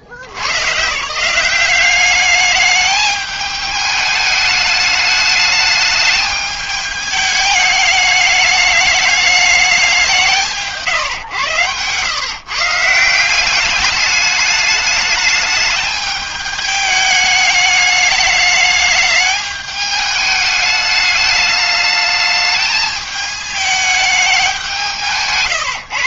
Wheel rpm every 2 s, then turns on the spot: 90, 210, 210, 210, 210, 160, 140, 210, 210, 210, 210, 210, 190.
none